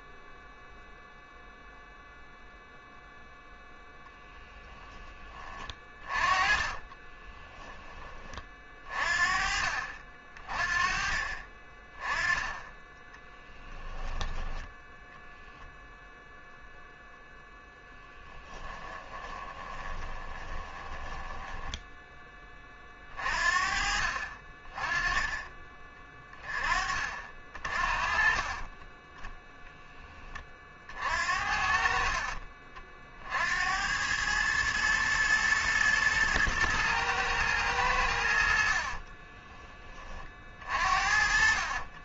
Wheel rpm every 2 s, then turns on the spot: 0, 0, 10, 30, 30, 30, 10, 10, 0, 10, 20, 30, 30, 30, 20, 50, 50, 110, 110, 50, 40.
6-8 18-22 38-42